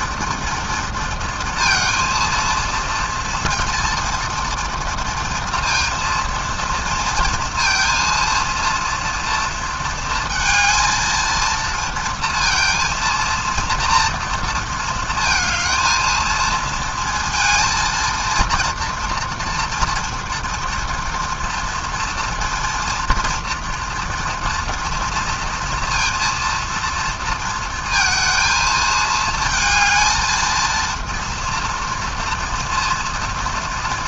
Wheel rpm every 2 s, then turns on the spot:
230, 230, 230, 230, 230, 220, 230, 230, 230, 230, 240, 230, 230, 230, 220, 220, 230.
none